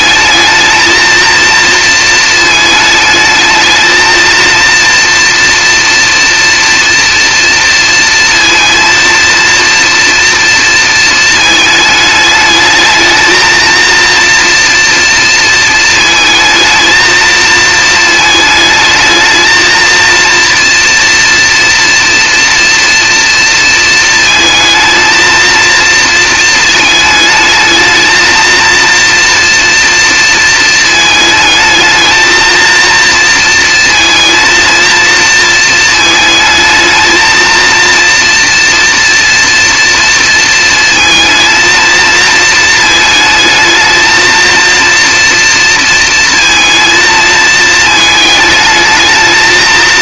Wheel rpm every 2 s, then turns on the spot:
220, 220, 230, 230, 230, 220, 220, 230, 220, 220, 230, 230, 230, 220, 230, 220, 230, 230, 220, 240, 230, 220, 230, 220, 220.
none